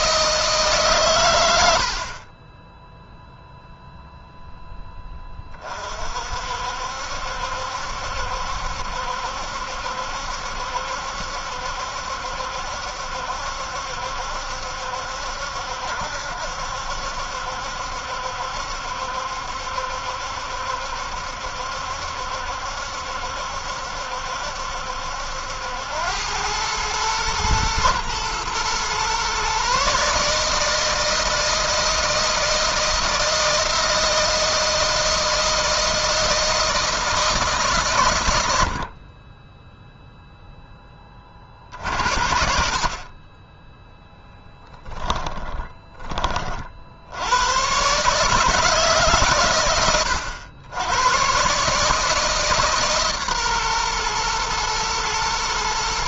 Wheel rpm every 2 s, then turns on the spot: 130, 0, 10, 60, 70, 70, 70, 70, 70, 70, 70, 70, 70, 110, 120, 160, 170, 160, 160, 40, 20, 40, 10, 60, 140, 100, 140, 120.
44-46